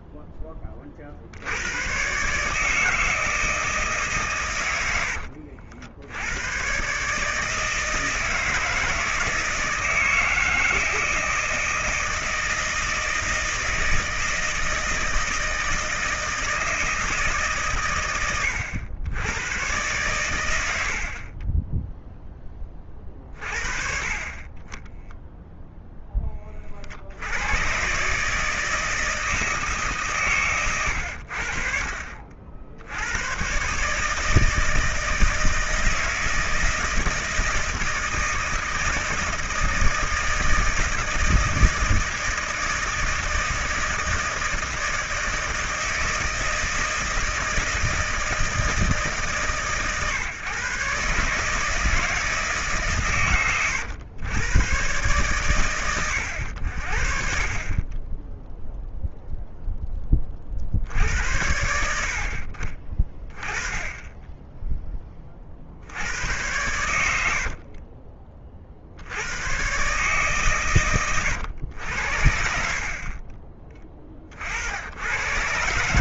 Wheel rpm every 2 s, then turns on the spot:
20, 150, 120, 110, 160, 160, 160, 160, 160, 100, 80, 20, 30, 30, 150, 120, 60, 160, 160, 160, 160, 160, 160, 160, 160, 130, 150, 120, 80, 10, 50, 40, 10, 100, 40, 130, 60, 60.
none